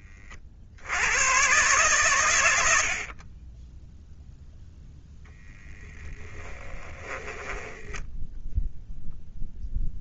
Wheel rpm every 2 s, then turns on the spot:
100, 60, 0, 10, 0.
6-8